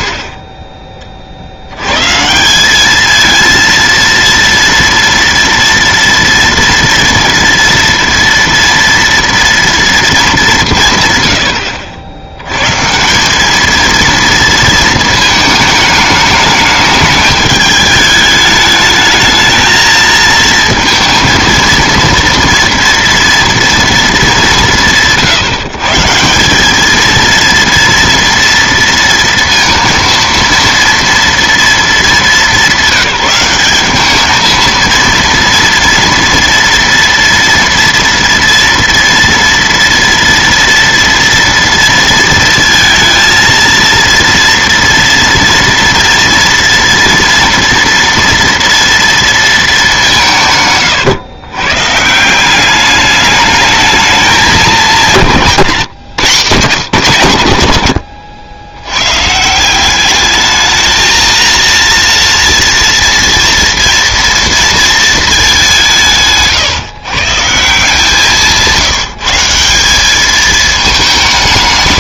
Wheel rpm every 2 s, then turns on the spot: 20, 200, 230, 230, 230, 170, 110, 230, 210, 210, 230, 230, 180, 200, 230, 230, 190, 230, 230, 240, 230, 230, 230, 230, 230, 130, 200, 200, 170, 90, 220, 230, 230, 130, 160, 220.
none